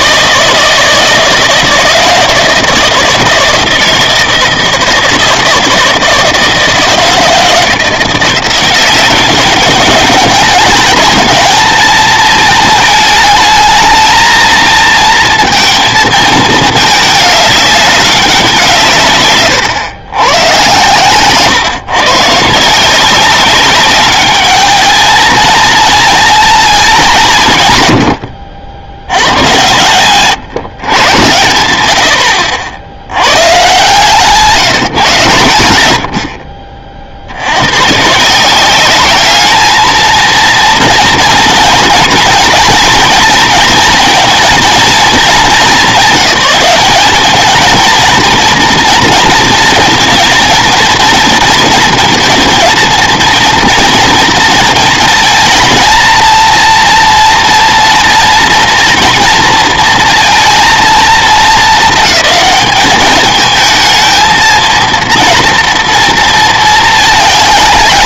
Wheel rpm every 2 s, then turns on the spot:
160, 160, 160, 160, 190, 210, 220, 230, 220, 160, 130, 160, 220, 220, 80, 130, 70, 160, 50, 180, 230, 230, 230, 200, 230, 230, 230, 230, 230, 230, 230, 210, 230, 220.
none